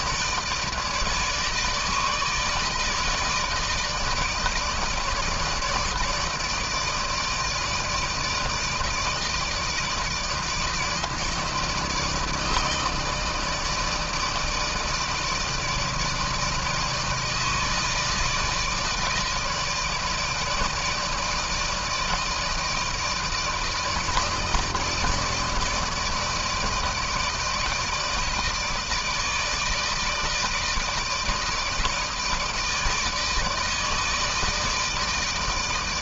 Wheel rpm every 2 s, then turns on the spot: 160, 160, 160, 160, 160, 150, 160, 160, 160, 160, 160, 160, 160, 160, 160, 160, 160, 160.
none